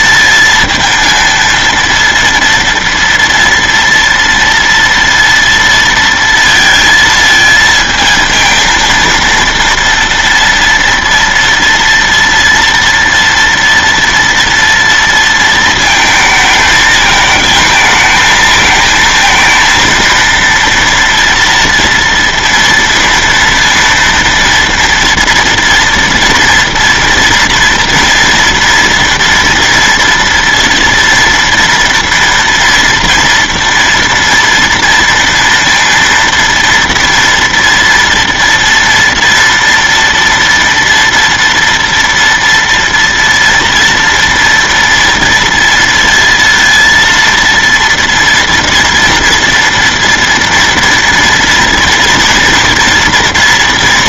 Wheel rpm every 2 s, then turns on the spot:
230, 230, 230, 230, 230, 230, 230, 230, 220, 220, 230, 230, 230, 230, 240, 230, 230, 230, 230, 230, 230, 230, 230, 230, 230, 230, 230.
none